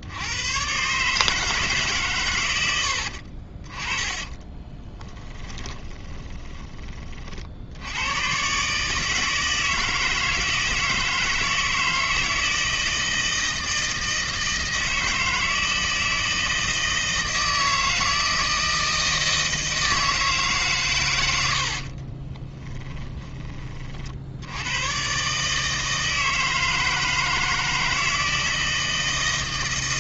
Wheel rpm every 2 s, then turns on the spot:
130, 90, 20, 20, 150, 160, 160, 160, 160, 160, 130, 10, 110, 160, 160.
2-6 22-24